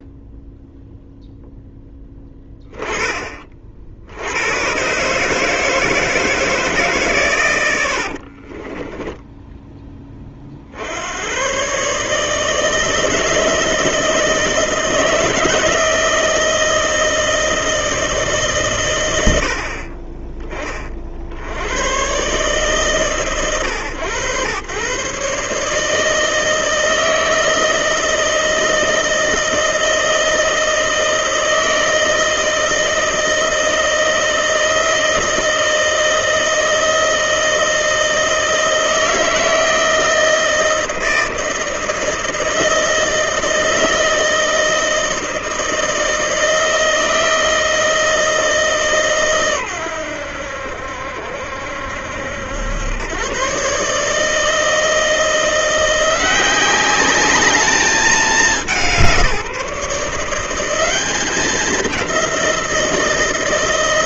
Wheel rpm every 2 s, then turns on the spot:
0, 20, 100, 160, 50, 40, 150, 160, 160, 130, 20, 130, 110, 160, 160, 160, 160, 170, 160, 160, 160, 170, 160, 160, 160, 80, 80, 160, 180, 190, 180, 180.
8-10